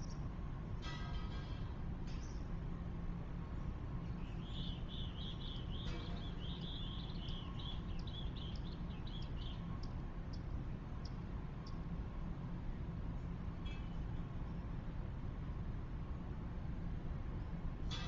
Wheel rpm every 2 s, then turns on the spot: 0, 0, 0, 0, 0, 0, 0, 0, 0.
none